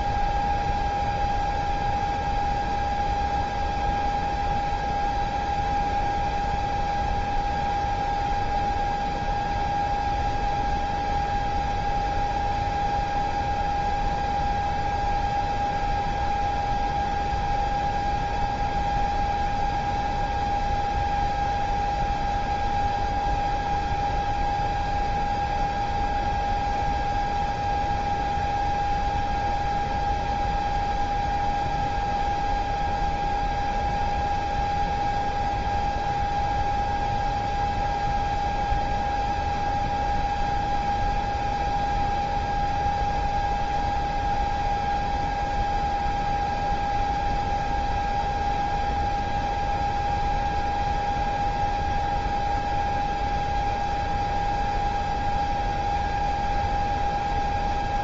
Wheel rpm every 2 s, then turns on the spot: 0, 0, 0, 0, 0, 0, 0, 0, 0, 0, 0, 0, 0, 0, 0, 0, 0, 0, 0, 0, 0, 0, 0, 0, 0, 0, 0, 0, 0.
none